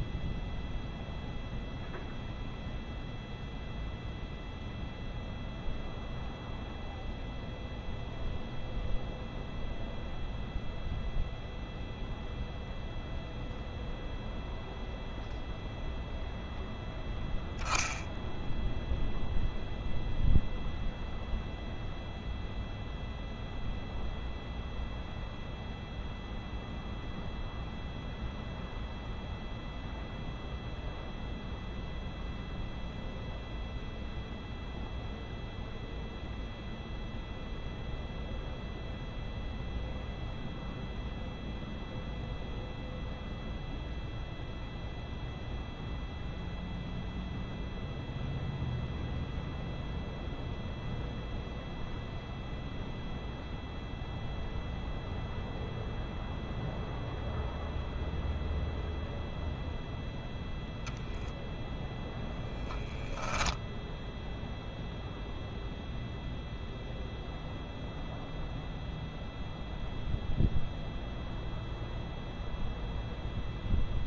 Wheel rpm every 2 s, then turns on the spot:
0, 0, 0, 0, 0, 0, 0, 0, 0, 0, 0, 0, 0, 0, 0, 0, 0, 0, 0, 0, 0, 0, 0, 0, 0, 0, 0, 0, 0, 0, 0, 0, 0, 0, 0, 0, 0.
none